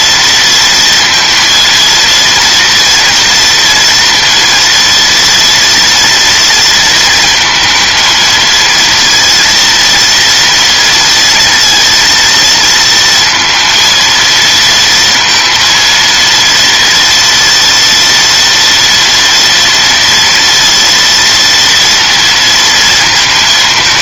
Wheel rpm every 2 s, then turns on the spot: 230, 240, 230, 230, 230, 230, 230, 230, 230, 230, 230, 230.
none